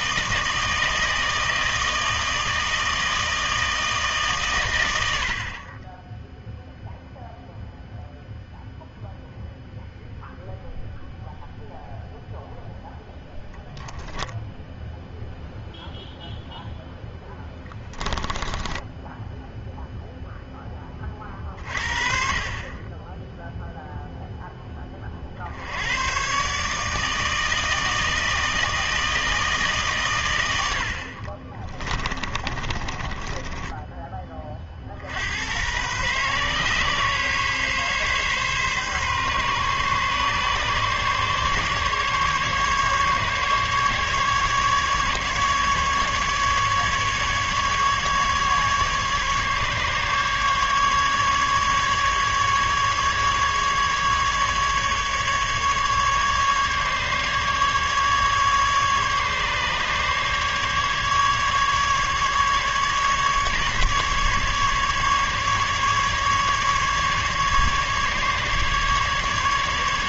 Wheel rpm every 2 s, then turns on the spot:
160, 160, 90, 0, 0, 0, 10, 10, 0, 10, 20, 20, 20, 150, 160, 70, 20, 50, 130, 140, 140, 140, 150, 150, 150, 150, 150, 140, 150, 150, 140, 150, 140, 140, 140.
32-34